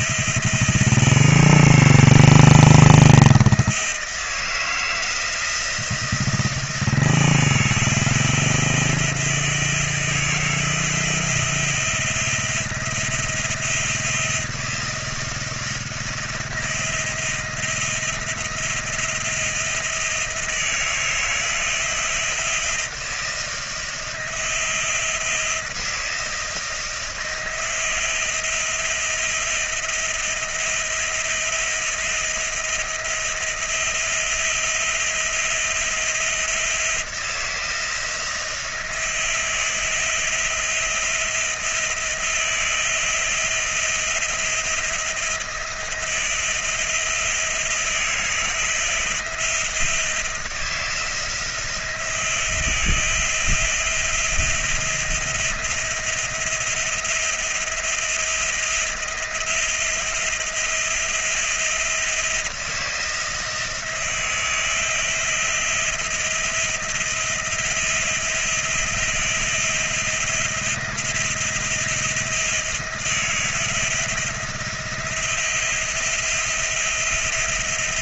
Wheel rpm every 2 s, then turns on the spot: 170, 170, 160, 160, 170, 160, 170, 170, 170, 170, 170, 160, 170, 160, 170, 170, 170, 170, 170, 160, 160, 170, 170, 170, 160, 160, 170, 170, 170, 170, 170, 170, 170, 170, 170, 170, 170, 170, 170.
none